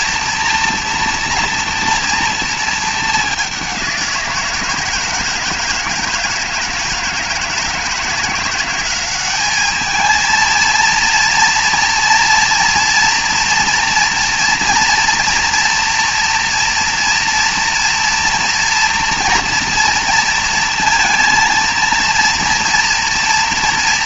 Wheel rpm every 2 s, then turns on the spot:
230, 220, 170, 160, 190, 230, 230, 230, 240, 240, 230, 240.
none